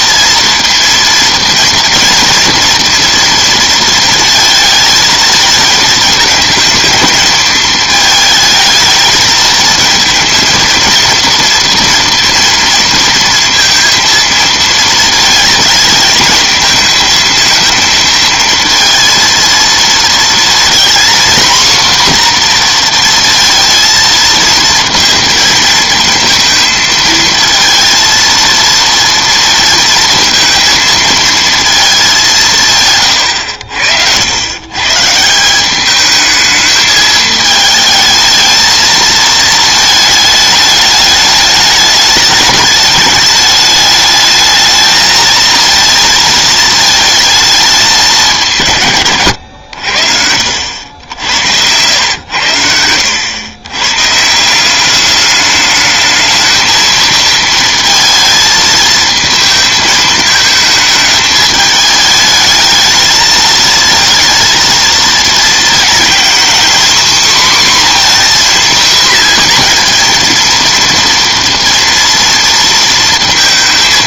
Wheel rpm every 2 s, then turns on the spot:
230, 230, 230, 220, 220, 230, 230, 220, 220, 230, 230, 240, 230, 220, 230, 230, 150, 120, 220, 220, 210, 210, 220, 220, 160, 70, 80, 180, 220, 220, 220, 220, 230, 250, 250, 230, 230.
none